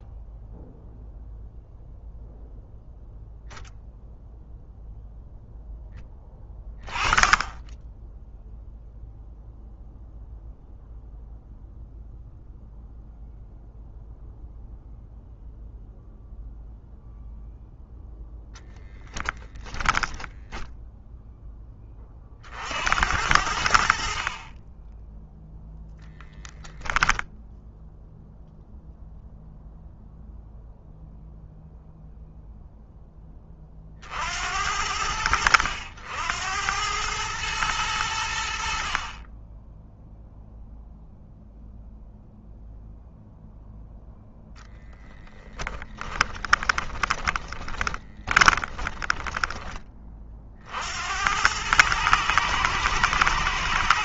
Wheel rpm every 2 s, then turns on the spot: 0, 0, 0, 20, 0, 0, 0, 0, 0, 10, 0, 80, 10, 0, 0, 0, 10, 80, 100, 50, 0, 0, 20, 20, 10, 70, 120.
44-50